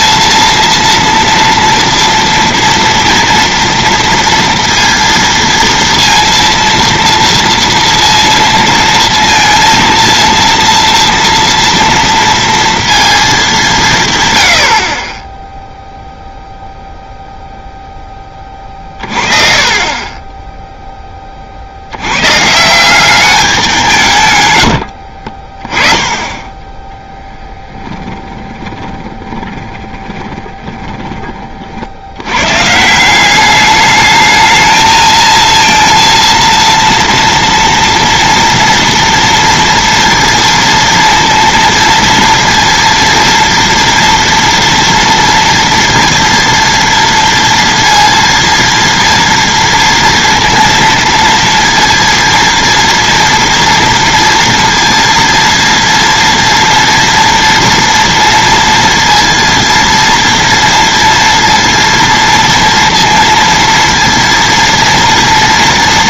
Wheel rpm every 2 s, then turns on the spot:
230, 230, 230, 230, 230, 230, 230, 90, 0, 30, 10, 150, 90, 10, 20, 10, 120, 220, 230, 240, 230, 230, 230, 230, 230, 230, 230, 230, 230, 230, 230, 230, 230.
24-26 28-32